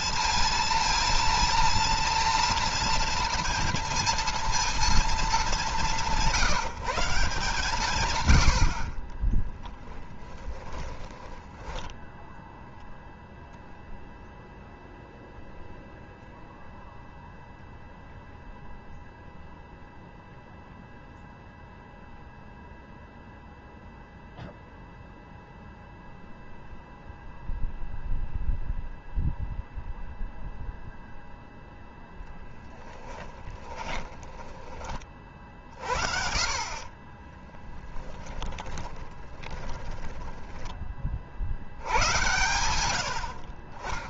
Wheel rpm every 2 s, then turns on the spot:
230, 230, 230, 180, 60, 20, 0, 0, 0, 0, 0, 0, 0, 0, 0, 0, 10, 30, 30, 10, 30, 110.
8-12 32-34 36-40